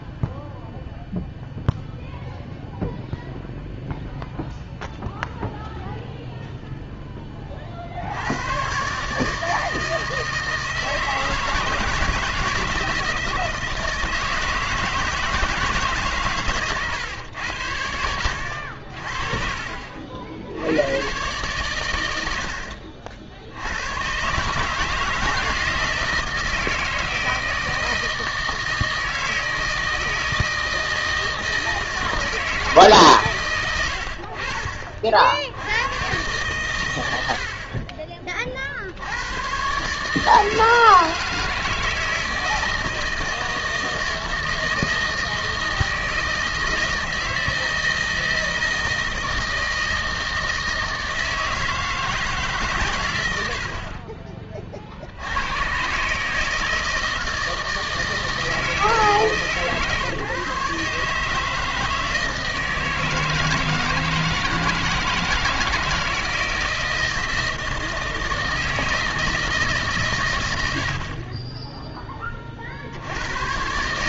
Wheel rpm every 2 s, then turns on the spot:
0, 0, 0, 0, 120, 160, 160, 160, 120, 70, 90, 60, 150, 160, 160, 160, 150, 40, 110, 60, 160, 160, 160, 160, 160, 160, 120, 50, 160, 160, 140, 160, 160, 160, 160, 70, 60.
34-36